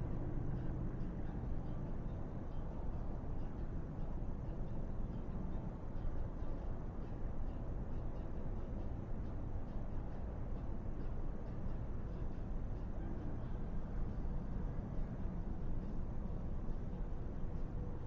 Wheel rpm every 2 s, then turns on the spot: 0, 0, 0, 0, 0, 0, 0, 0, 0.
none